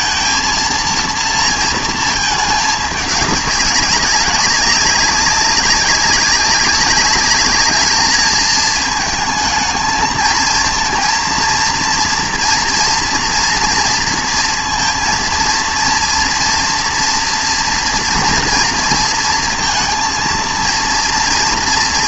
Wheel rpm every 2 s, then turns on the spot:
230, 210, 190, 200, 220, 230, 240, 230, 240, 230, 230.
none